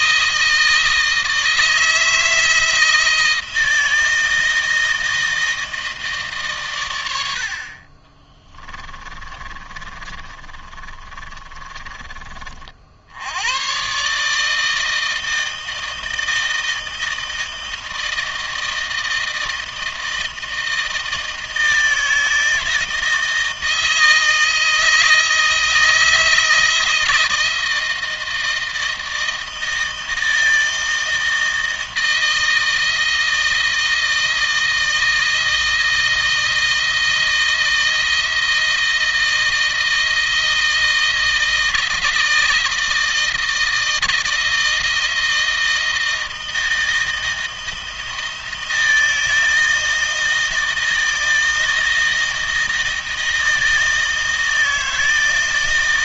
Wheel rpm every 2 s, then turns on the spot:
160, 160, 160, 120, 20, 30, 50, 160, 160, 160, 160, 160, 160, 160, 160, 160, 160, 160, 160, 160, 160, 160, 160, 160, 160, 160, 160, 160.
8-12